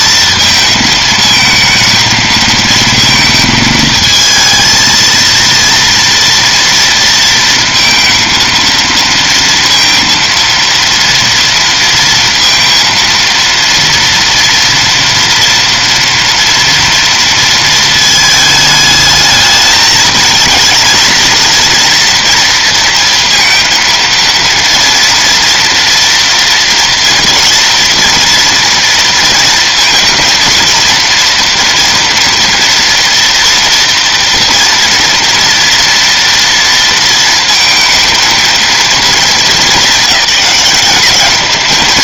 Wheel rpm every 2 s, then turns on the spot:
220, 220, 220, 230, 230, 230, 230, 230, 230, 220, 230, 230, 230, 240, 230, 230, 230, 230, 230, 230, 190.
none